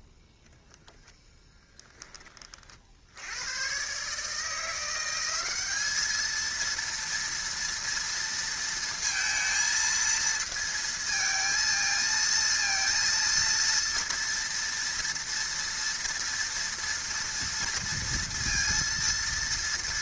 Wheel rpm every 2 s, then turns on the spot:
10, 40, 160, 230, 230, 230, 230, 230, 230, 230.
none